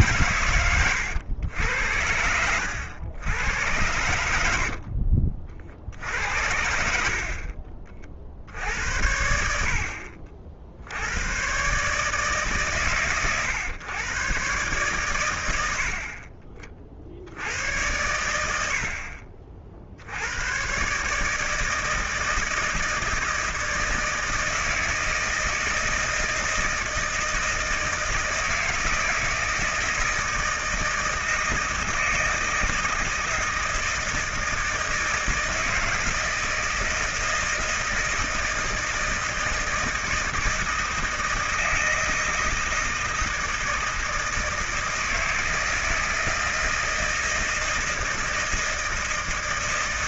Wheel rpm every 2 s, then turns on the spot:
110, 80, 80, 70, 60, 50, 140, 120, 40, 80, 110, 160, 160, 160, 160, 160, 160, 160, 160, 160, 160, 160, 160, 160, 160.
4-6